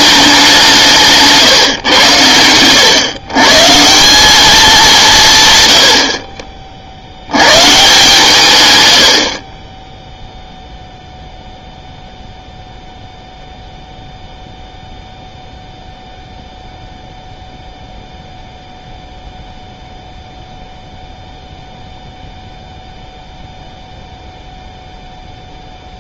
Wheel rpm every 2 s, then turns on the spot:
190, 100, 200, 40, 120, 0, 0, 0, 0, 0, 0, 0, 0.
none